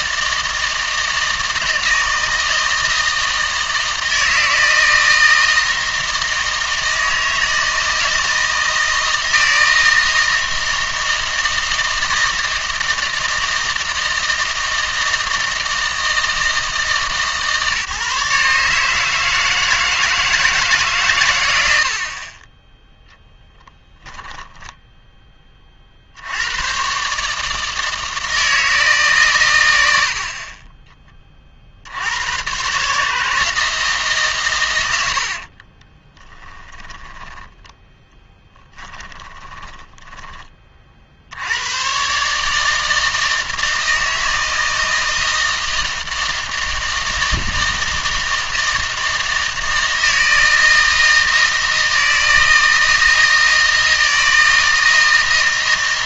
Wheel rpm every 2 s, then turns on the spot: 160, 160, 160, 160, 160, 160, 160, 160, 150, 140, 160, 20, 10, 110, 160, 20, 130, 110, 10, 20, 30, 150, 160, 160, 160, 160, 160, 160.
36-40